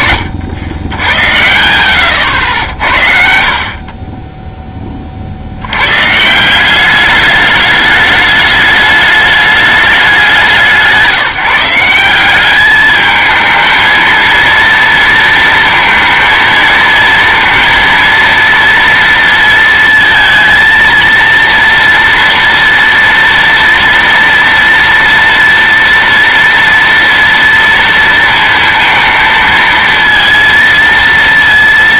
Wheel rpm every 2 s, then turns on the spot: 80, 60, 10, 180, 210, 180, 210, 230, 230, 230, 230, 230, 230, 240, 230, 230.
2-4